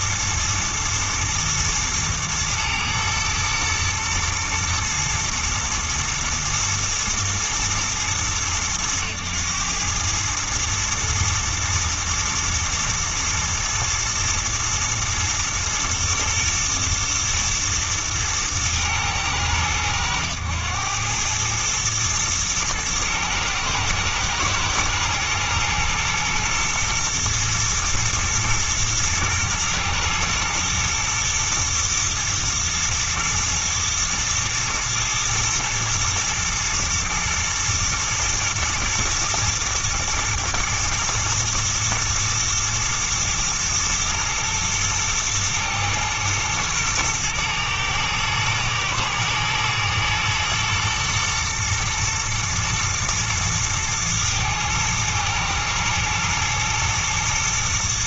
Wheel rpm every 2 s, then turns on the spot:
120, 110, 120, 120, 110, 110, 110, 110, 120, 110, 100, 110, 110, 110, 110, 120, 120, 120, 120, 110, 120, 110, 120, 110, 120, 120, 110, 110, 110.
none